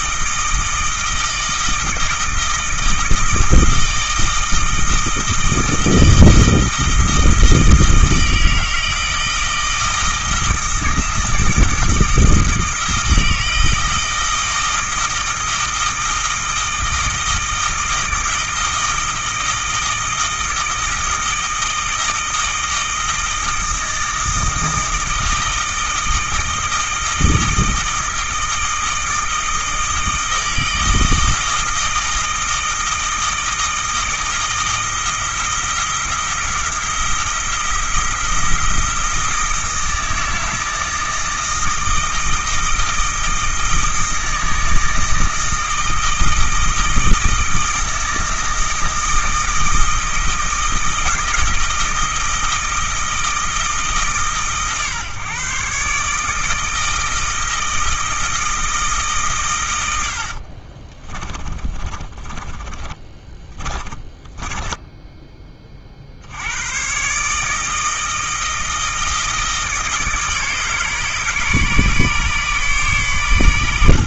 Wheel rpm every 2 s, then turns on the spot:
160, 160, 160, 160, 160, 160, 160, 160, 160, 160, 160, 160, 160, 160, 160, 160, 160, 160, 170, 170, 160, 160, 160, 160, 160, 160, 160, 140, 160, 160, 40, 30, 20, 110, 160, 140, 140.
60-66